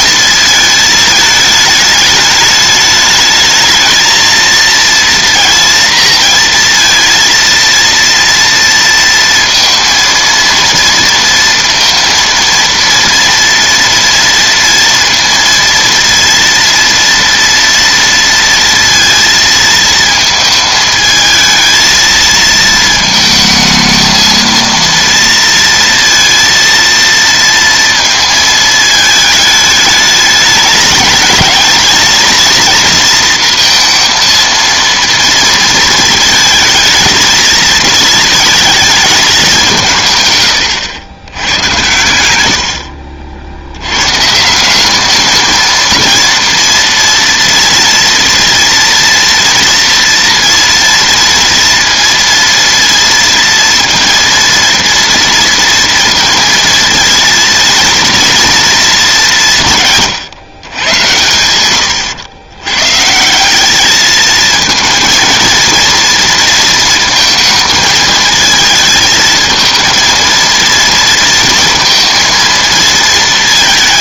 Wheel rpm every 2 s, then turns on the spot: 220, 210, 230, 230, 230, 230, 230, 230, 230, 230, 220, 220, 230, 230, 220, 210, 230, 230, 230, 220, 100, 70, 170, 230, 230, 230, 230, 230, 230, 230, 120, 110, 220, 230, 220, 230, 230.
42-44